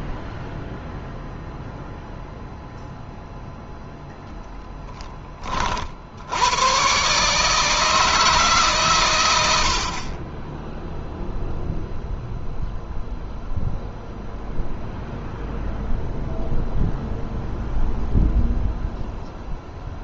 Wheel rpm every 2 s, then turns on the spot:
0, 0, 10, 120, 120, 0, 0, 0, 0, 0.
none